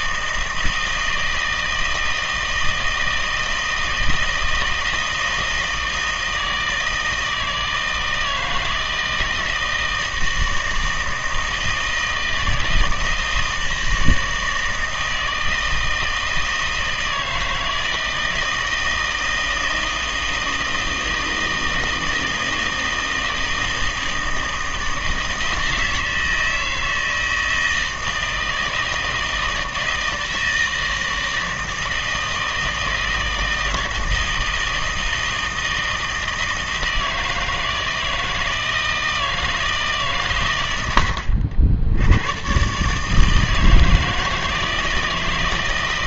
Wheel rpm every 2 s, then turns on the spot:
160, 160, 160, 160, 160, 160, 160, 160, 160, 160, 160, 160, 160, 160, 160, 160, 160, 160, 160, 160, 110, 130, 160.
none